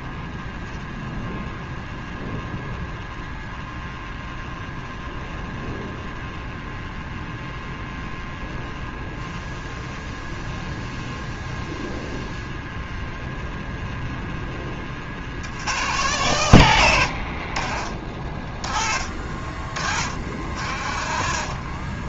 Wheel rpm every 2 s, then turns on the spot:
0, 0, 0, 0, 0, 0, 0, 20, 100, 40, 60.
none